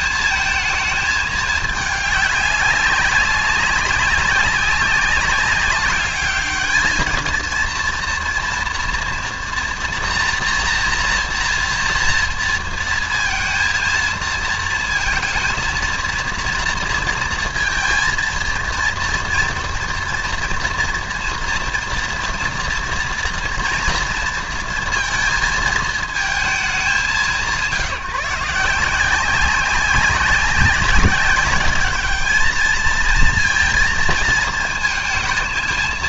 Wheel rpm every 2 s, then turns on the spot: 220, 200, 190, 220, 230, 240, 230, 220, 230, 230, 230, 230, 230, 200, 170, 190, 220, 220.
none